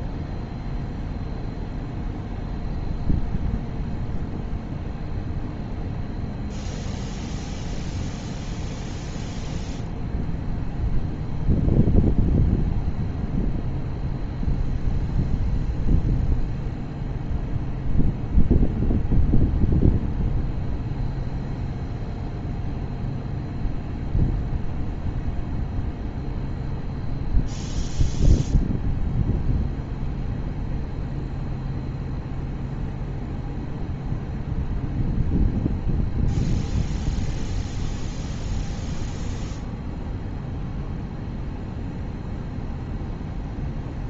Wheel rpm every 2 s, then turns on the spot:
0, 0, 0, 0, 0, 0, 0, 0, 0, 0, 0, 0, 0, 0, 0, 0, 0, 0, 0, 0, 0, 0.
none